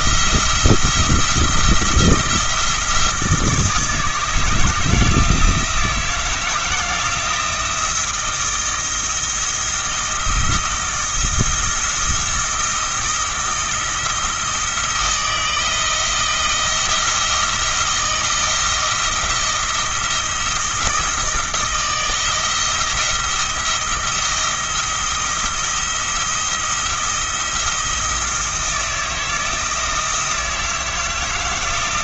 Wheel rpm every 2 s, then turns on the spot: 170, 170, 160, 160, 160, 170, 170, 160, 170, 170, 170, 170, 170, 170, 170, 160.
none